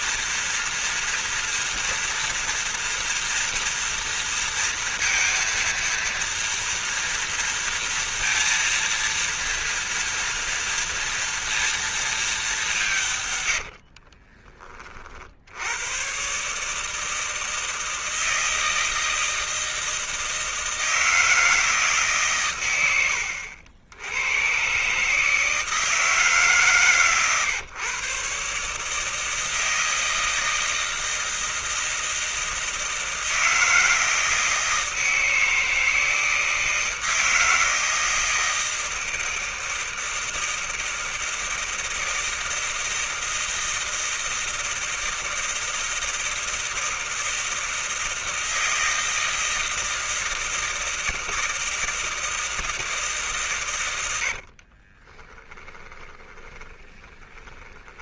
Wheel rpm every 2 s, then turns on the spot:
240, 230, 230, 230, 230, 230, 220, 30, 110, 160, 160, 150, 100, 160, 130, 160, 160, 160, 160, 160, 160, 160, 160, 160, 160, 160, 160, 80, 20.
14-16 56-58